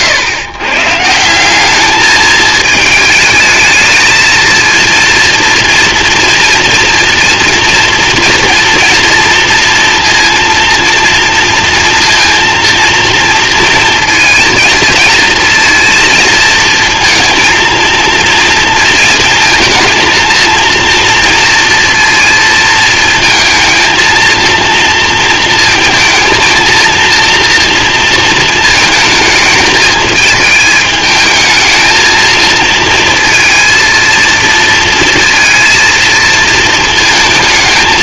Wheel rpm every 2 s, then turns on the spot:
120, 210, 230, 230, 240, 230, 230, 230, 230, 230, 230, 230, 230, 230, 220, 210, 220, 230, 230.
none